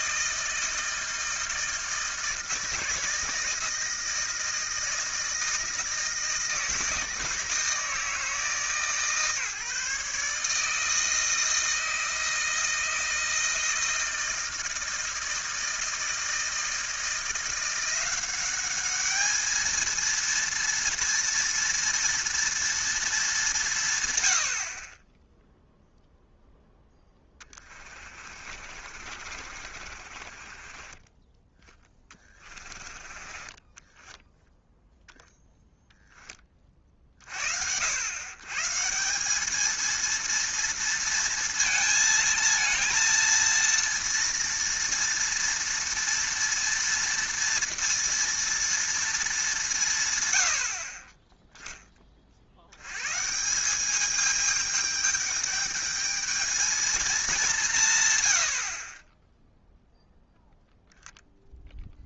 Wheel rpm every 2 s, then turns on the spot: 160, 160, 160, 160, 160, 150, 160, 160, 160, 200, 230, 230, 60, 0, 40, 30, 20, 0, 20, 140, 230, 230, 230, 230, 230, 70, 70, 210, 220, 80, 0.
28-34